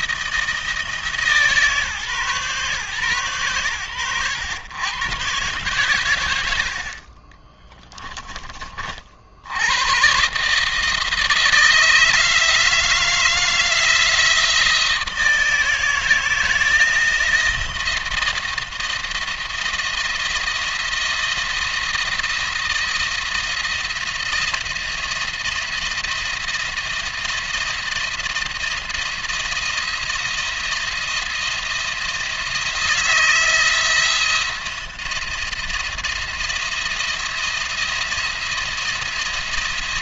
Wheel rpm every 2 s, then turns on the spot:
160, 140, 120, 70, 30, 150, 160, 170, 160, 160, 160, 170, 170, 170, 170, 170, 160, 170, 170, 170.
none